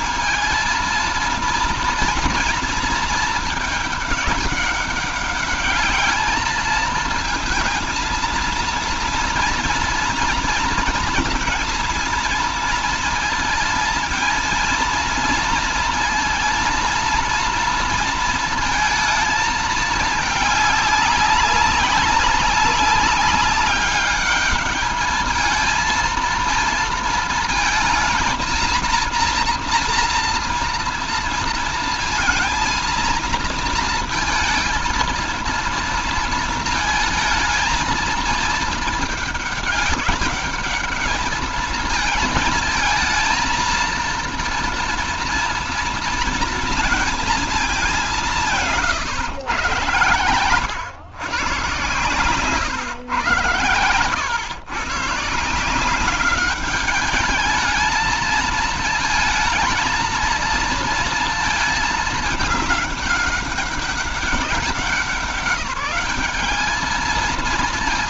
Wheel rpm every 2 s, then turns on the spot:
230, 230, 200, 220, 230, 230, 230, 220, 230, 230, 210, 200, 210, 230, 230, 240, 230, 230, 230, 220, 210, 220, 230, 230, 160, 110, 130, 110, 200, 220, 230, 210, 190, 210.
48-50